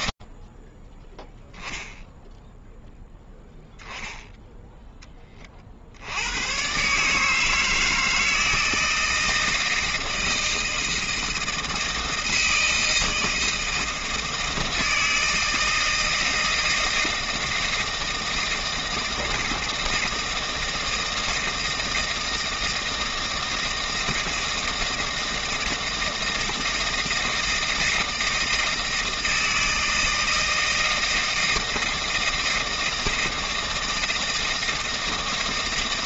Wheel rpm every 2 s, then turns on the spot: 0, 0, 40, 160, 160, 160, 160, 160, 160, 160, 160, 160, 160, 160, 160, 160, 160, 160.
none